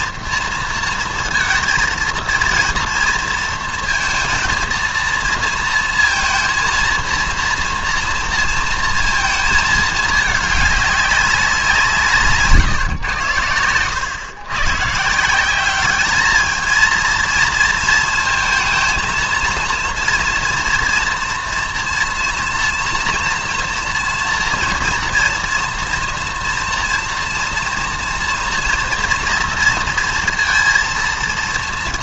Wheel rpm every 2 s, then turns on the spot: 230, 230, 230, 230, 230, 210, 140, 130, 220, 230, 230, 230, 230, 230, 240, 230.
none